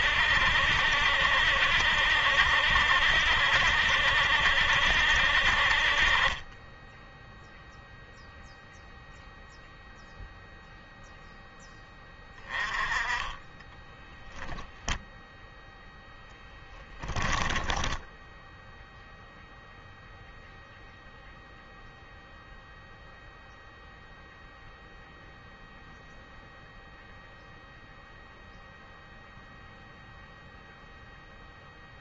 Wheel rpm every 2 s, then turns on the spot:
70, 70, 70, 10, 0, 0, 20, 0, 20, 0, 0, 0, 0, 0, 0, 0.
16-18